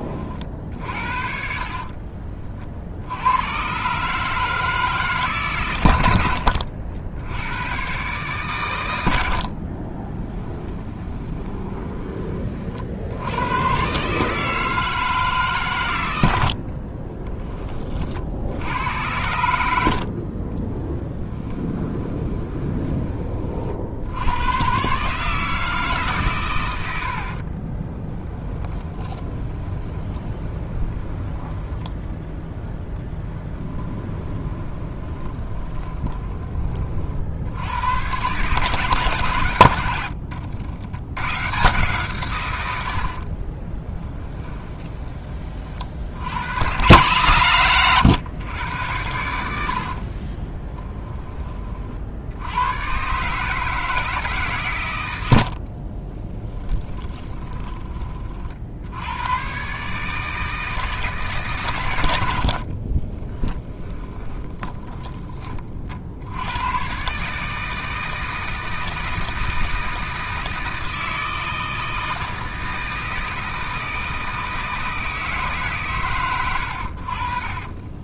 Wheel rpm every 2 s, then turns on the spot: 50, 70, 150, 80, 80, 20, 70, 150, 30, 90, 10, 20, 140, 70, 20, 20, 10, 20, 30, 140, 90, 100, 20, 100, 100, 20, 110, 130, 10, 60, 160, 60, 10, 100, 160, 160, 160, 160, 100.
0-2 10-12 16-18 20-22 28-32 34-36 44-46 50-52 56-58 62-66